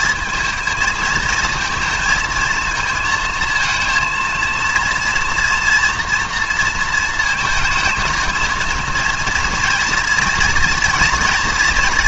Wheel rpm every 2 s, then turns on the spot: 220, 230, 230, 230, 220, 230.
none